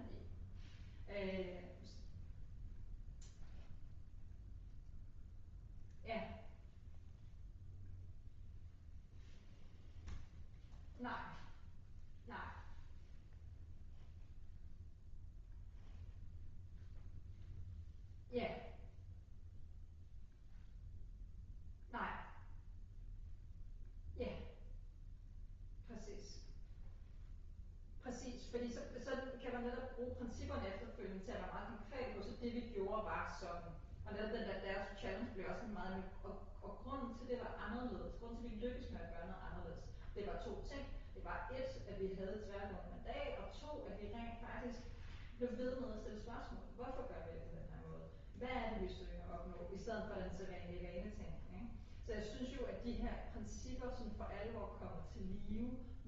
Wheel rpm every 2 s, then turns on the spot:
0, 0, 0, 0, 0, 0, 0, 0, 0, 0, 0, 0, 0, 0, 0, 0, 0, 0, 0, 0, 0, 0, 0, 0, 0, 0, 0, 0.
none